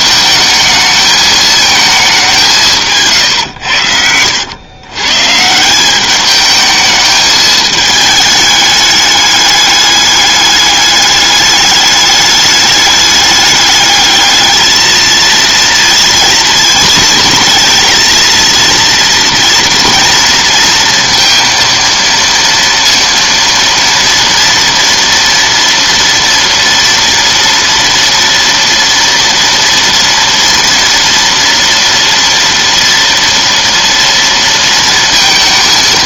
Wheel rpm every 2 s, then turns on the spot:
220, 170, 110, 220, 210, 210, 210, 220, 220, 230, 230, 230, 230, 230, 230, 230, 230, 230.
none